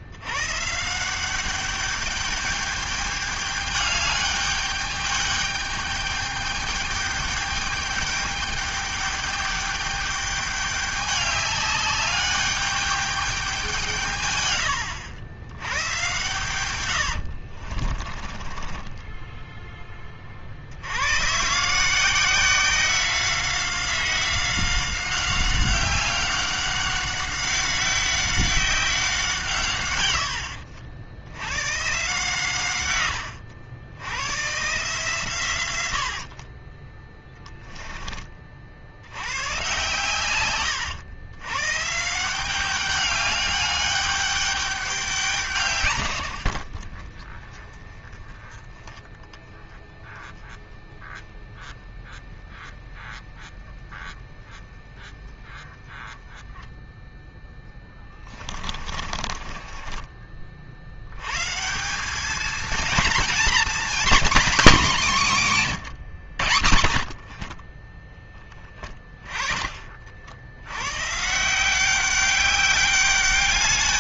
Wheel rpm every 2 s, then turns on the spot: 100, 210, 210, 210, 210, 200, 200, 140, 120, 30, 40, 170, 190, 190, 190, 90, 130, 120, 50, 30, 130, 170, 200, 100, 10, 10, 10, 10, 10, 20, 30, 200, 250, 130, 20, 70, 190.
16-20 36-38 58-60